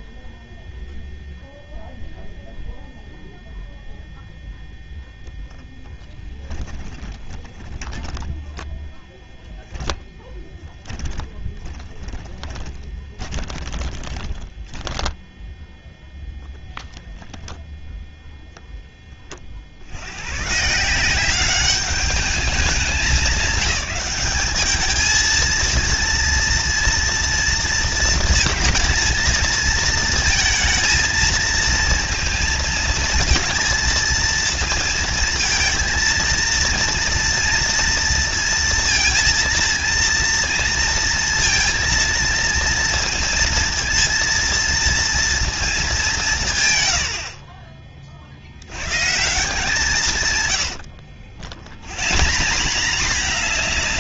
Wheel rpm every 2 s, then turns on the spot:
0, 10, 10, 10, 30, 20, 0, 0, 50, 190, 200, 230, 230, 230, 230, 230, 230, 230, 230, 230, 230, 230, 50, 140, 60, 210, 190.
2-12 48-50